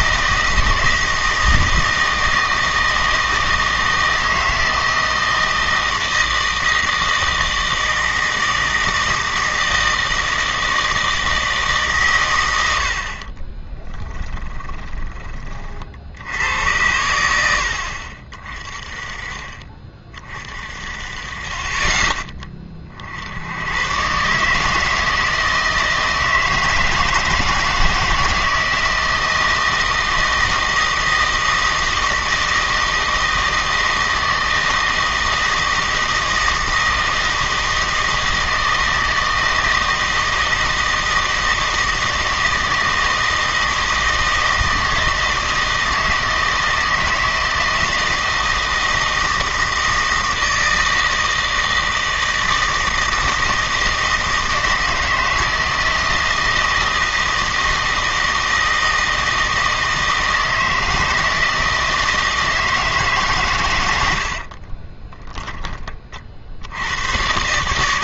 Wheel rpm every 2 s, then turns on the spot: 160, 160, 160, 160, 160, 160, 80, 20, 90, 30, 40, 40, 150, 160, 160, 160, 160, 160, 160, 160, 160, 160, 160, 160, 160, 160, 160, 160, 160, 160, 160, 160, 30, 80.
14-16 64-66